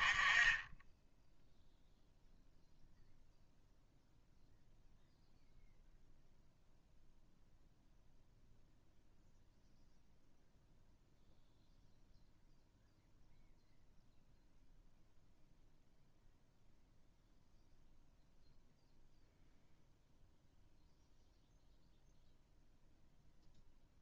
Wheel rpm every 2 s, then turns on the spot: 0, 0, 0, 0, 0, 0, 0, 0, 0, 0, 0, 0.
none